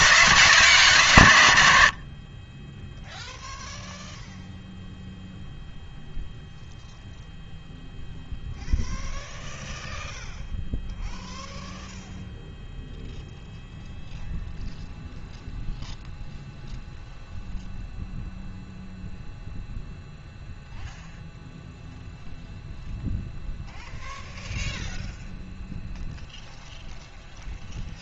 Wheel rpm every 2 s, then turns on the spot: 160, 0, 0, 0, 0, 0, 0, 0, 0, 0, 0, 0, 0, 0.
none